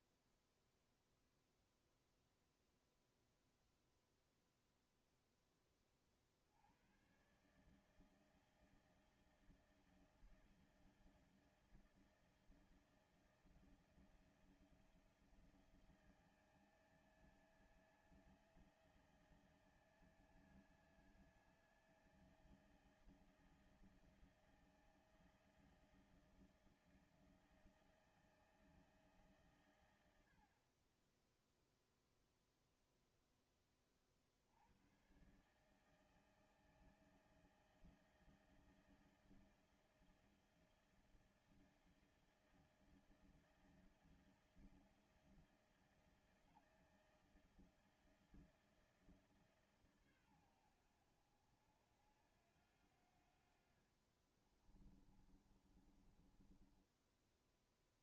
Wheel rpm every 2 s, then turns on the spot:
0, 0, 0, 50, 160, 160, 160, 170, 160, 160, 160, 160, 160, 160, 160, 90, 0, 40, 160, 160, 160, 160, 160, 160, 160, 120, 80, 40, 20.
54-58